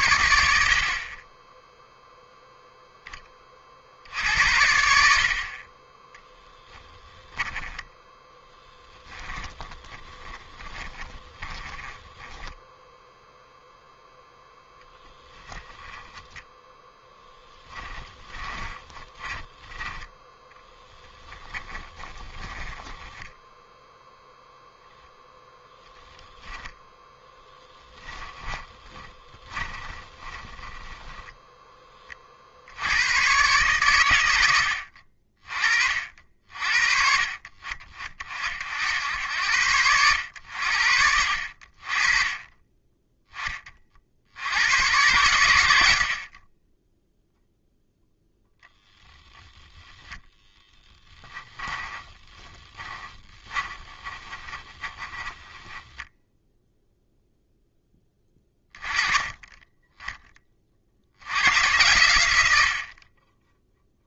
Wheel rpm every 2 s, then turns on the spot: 50, 0, 70, 10, 10, 20, 10, 0, 10, 20, 10, 10, 0, 10, 20, 20, 80, 70, 50, 80, 70, 20, 100, 20, 0, 10, 20, 20, 0, 20, 50, 60.
8-12 18-24 28-32 50-56